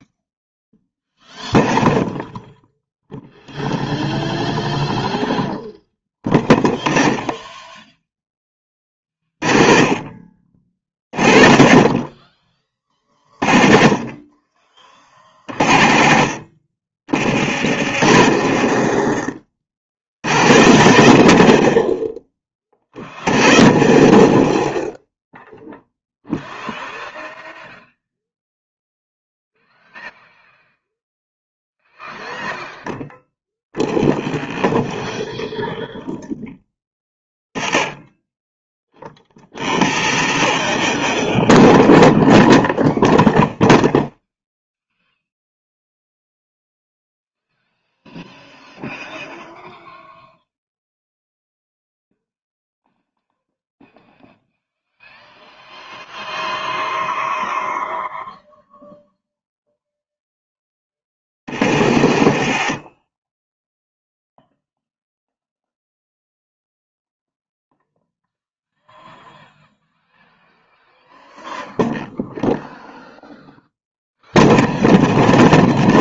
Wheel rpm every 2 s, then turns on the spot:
0, 0, 0, 10, 20, 50, 30, 40, 40, 50, 80, 20, 10, 0, 0, 0, 0, 0, 10, 10, 30, 0, 0, 0, 0, 0, 0, 0, 0, 0, 10, 30, 0, 0, 0, 0, 0, 0.
18-22 60-64